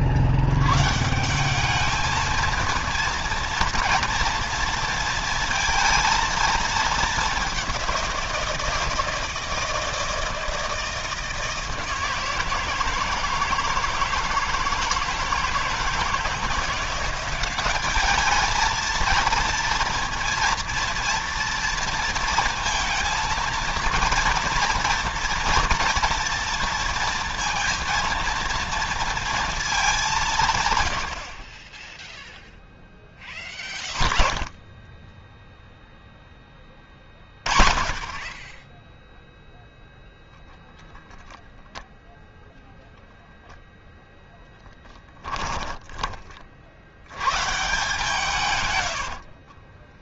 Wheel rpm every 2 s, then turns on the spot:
110, 230, 230, 220, 170, 160, 160, 160, 180, 230, 240, 230, 230, 230, 230, 130, 10, 20, 20, 10, 0, 0, 10, 60, 110.
44-46 48-50